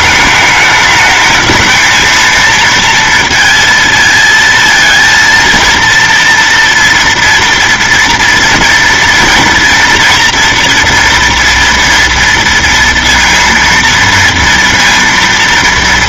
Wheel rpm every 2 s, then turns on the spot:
210, 230, 230, 230, 240, 240, 230, 230.
none